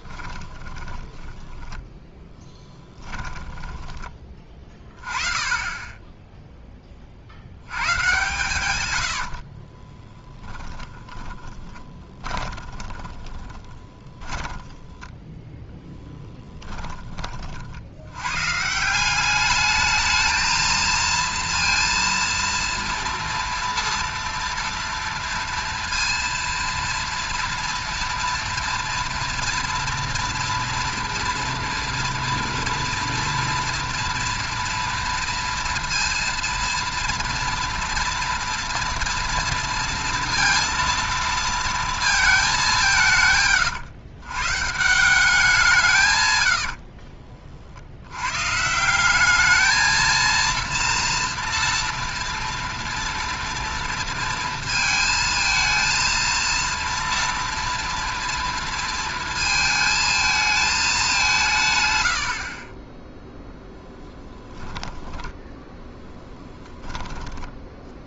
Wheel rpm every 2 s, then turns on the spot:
10, 10, 20, 10, 120, 10, 20, 10, 10, 140, 230, 230, 230, 230, 230, 230, 230, 230, 230, 240, 230, 200, 140, 90, 140, 230, 230, 230, 230, 230, 220, 50, 10, 20.
0-4 8-18 46-48 62-68